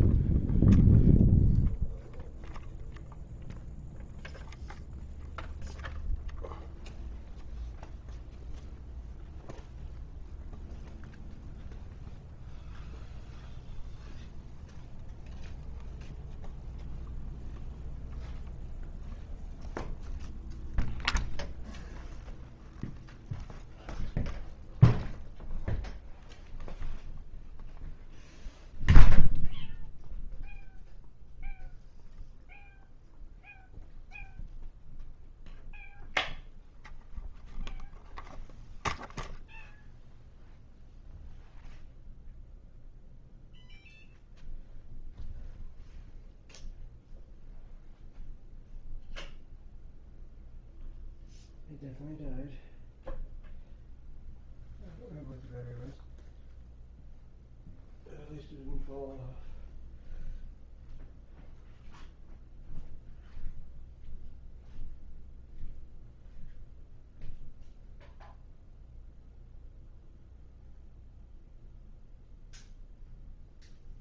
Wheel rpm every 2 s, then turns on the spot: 0, 0, 0, 0, 0, 0, 0, 0, 0, 0, 0, 0, 0, 0, 0, 0, 0, 0, 0, 0, 0, 0, 0, 0, 0, 0, 0, 0, 0, 0, 0, 0, 0, 0, 0, 0, 0.
none